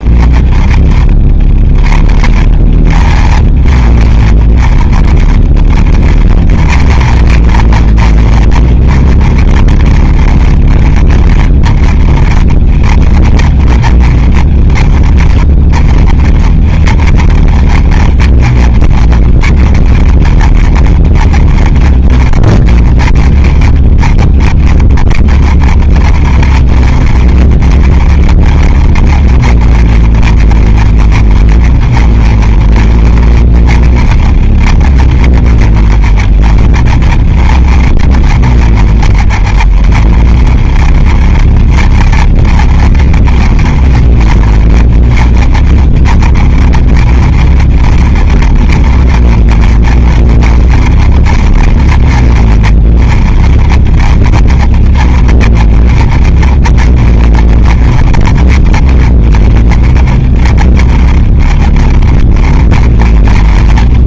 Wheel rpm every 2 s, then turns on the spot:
20, 30, 30, 40, 30, 30, 30, 30, 30, 30, 40, 30, 30, 40, 40, 40, 30, 30, 30, 40, 30, 30, 30, 30, 30, 30, 30, 30, 30, 30, 20, 30.
none